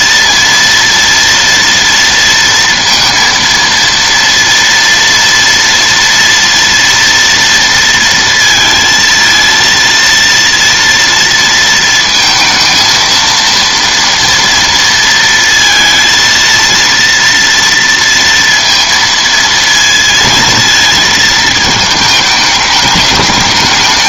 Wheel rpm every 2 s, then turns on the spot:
230, 230, 230, 230, 230, 230, 230, 230, 230, 230, 220, 210.
none